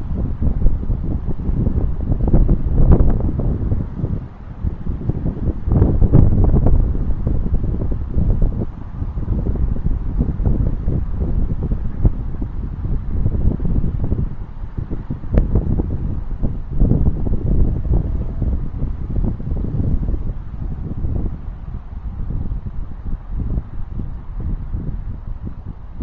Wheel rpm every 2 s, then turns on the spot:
0, 0, 0, 0, 0, 0, 0, 0, 0, 0, 0, 0, 0.
none